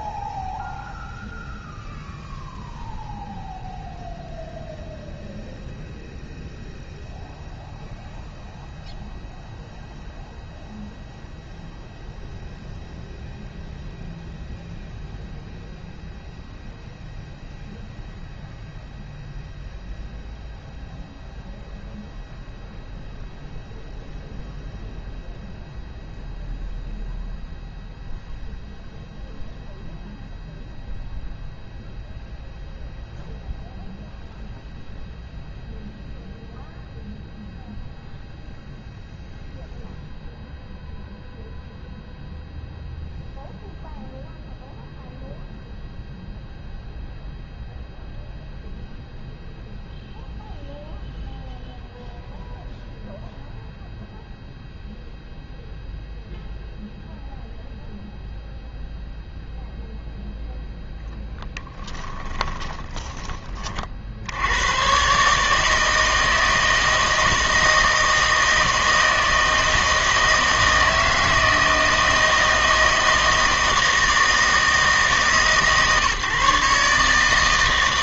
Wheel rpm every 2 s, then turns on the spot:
0, 0, 0, 0, 0, 0, 0, 0, 0, 0, 0, 0, 0, 0, 0, 0, 0, 0, 0, 0, 0, 0, 0, 0, 0, 0, 0, 0, 0, 0, 10, 30, 100, 160, 160, 160, 160, 160, 150.
62-64